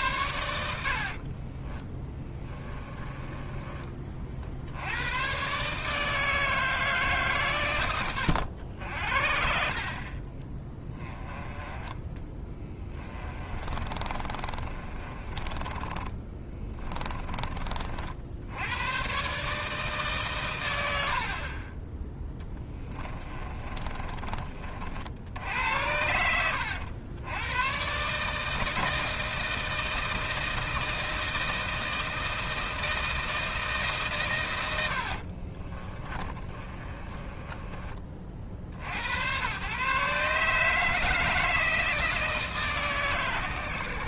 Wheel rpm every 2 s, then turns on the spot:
70, 20, 90, 160, 80, 10, 20, 30, 20, 100, 90, 20, 60, 90, 160, 160, 160, 80, 30, 80, 160, 150.
0-4 12-18 22-24 34-38